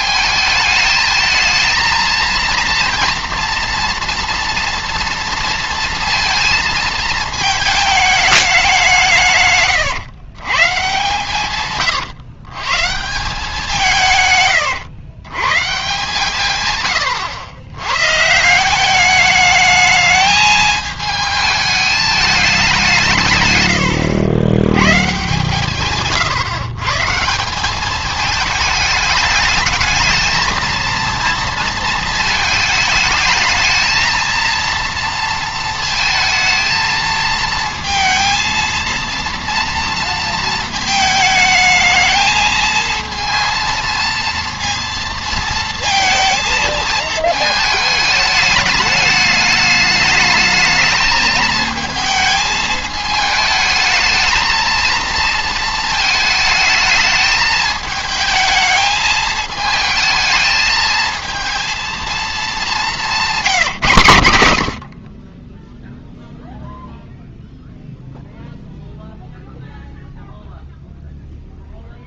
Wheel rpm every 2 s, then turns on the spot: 220, 230, 230, 230, 190, 140, 140, 110, 120, 170, 220, 190, 110, 130, 210, 230, 220, 230, 230, 230, 220, 220, 230, 220, 210, 220, 220, 220, 220, 220, 220, 200, 70, 0, 0, 0.
none